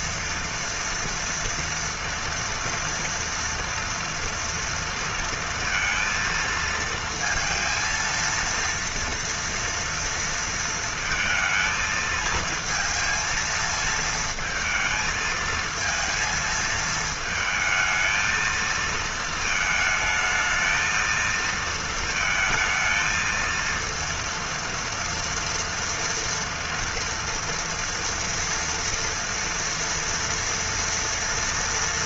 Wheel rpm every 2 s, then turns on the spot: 230, 230, 230, 230, 230, 230, 220, 230, 220, 230, 220, 230, 230, 230, 240, 230.
none